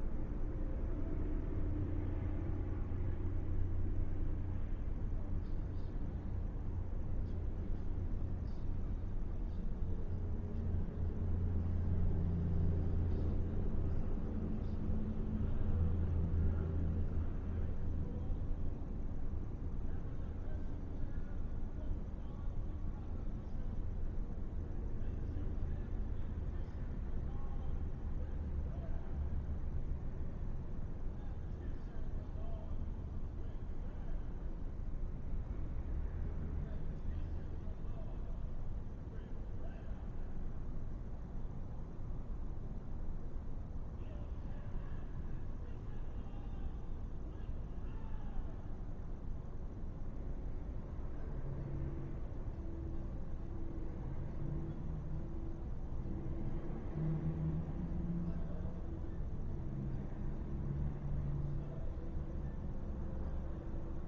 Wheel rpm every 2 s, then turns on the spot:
0, 0, 0, 0, 0, 0, 0, 0, 0, 0, 0, 0, 0, 0, 0, 0, 0, 0, 0, 0, 0, 0, 0, 0, 0, 0, 0, 0, 0, 0, 0, 0.
none